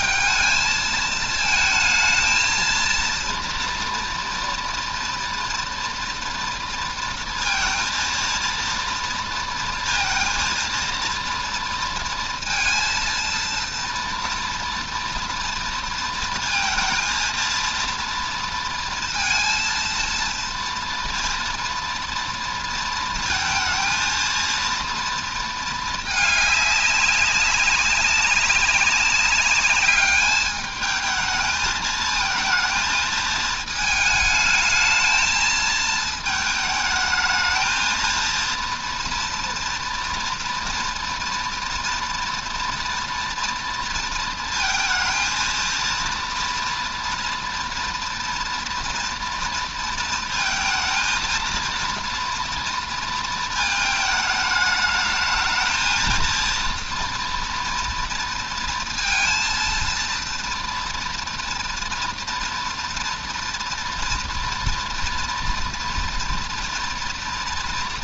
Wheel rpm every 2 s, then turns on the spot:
220, 230, 230, 230, 230, 230, 230, 230, 230, 230, 230, 230, 230, 200, 200, 220, 220, 220, 220, 230, 230, 230, 220, 230, 240, 230, 230, 220, 230, 230, 240, 230, 240, 230.
none